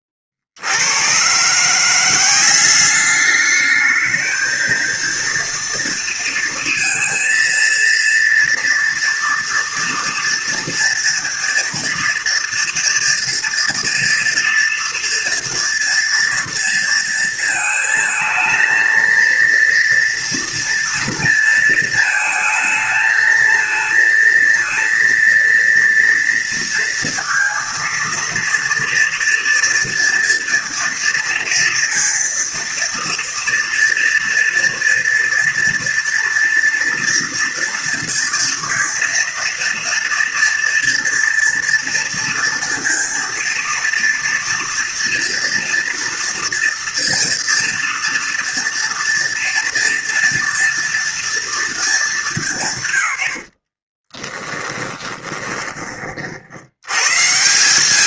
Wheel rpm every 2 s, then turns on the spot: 40, 190, 220, 230, 240, 230, 230, 230, 230, 220, 230, 220, 230, 230, 230, 230, 230, 230, 230, 230, 230, 230, 240, 230, 230, 230, 180, 20, 80.
54-56